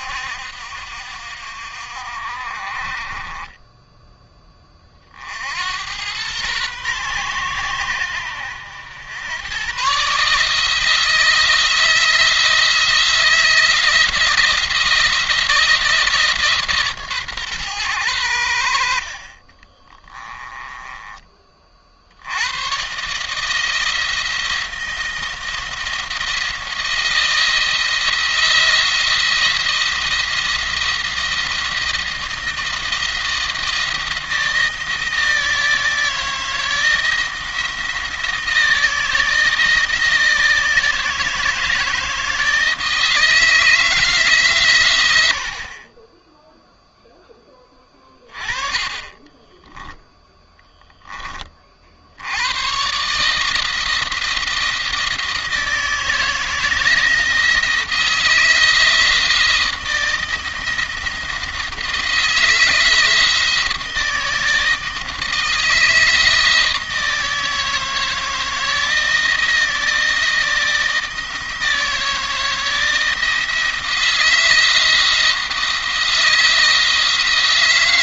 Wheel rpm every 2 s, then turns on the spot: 60, 50, 30, 120, 90, 160, 160, 170, 140, 70, 20, 130, 170, 170, 170, 170, 160, 160, 160, 160, 160, 160, 120, 0, 30, 10, 120, 160, 160, 160, 170, 160, 160, 160, 170, 160, 160, 160, 160.
18-20 48-50